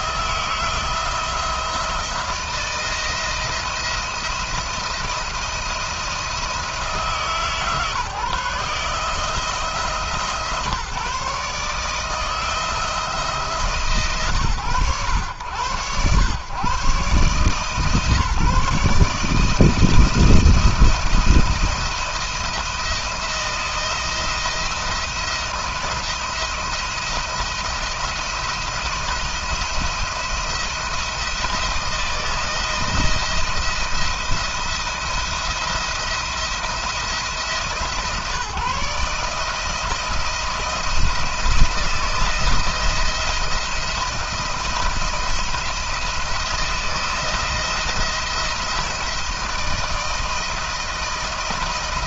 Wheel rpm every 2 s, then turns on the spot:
170, 170, 170, 160, 150, 160, 170, 120, 130, 160, 170, 170, 170, 170, 170, 170, 160, 170, 160, 150, 160, 170, 170, 170, 160, 160.
none